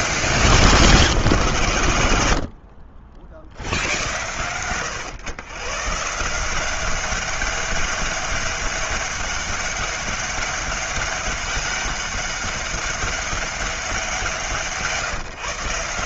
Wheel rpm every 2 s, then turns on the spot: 180, 70, 110, 190, 200, 200, 200, 160.
none